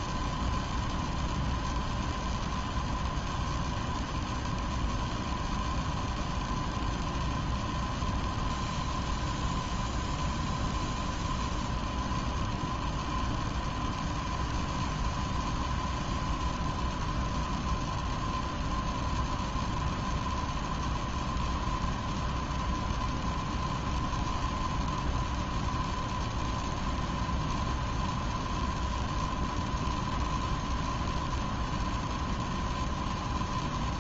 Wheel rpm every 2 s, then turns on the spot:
0, 0, 0, 0, 0, 0, 0, 0, 0, 0, 0, 0, 0, 0, 0, 0, 0.
none